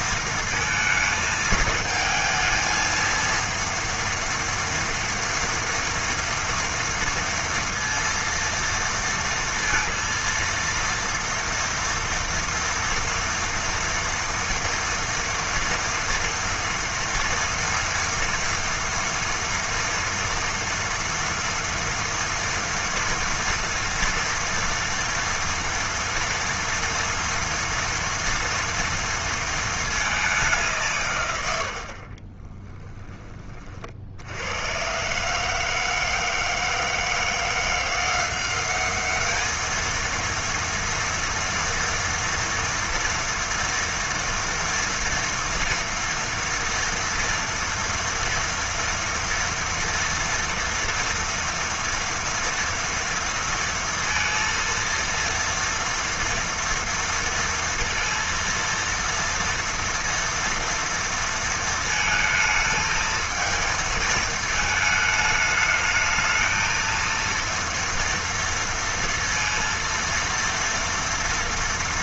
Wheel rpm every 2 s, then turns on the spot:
230, 230, 230, 230, 230, 230, 230, 230, 230, 230, 230, 230, 230, 230, 230, 190, 20, 90, 160, 190, 230, 230, 230, 230, 230, 230, 230, 230, 230, 230, 230, 220, 220, 220, 230, 230.
32-34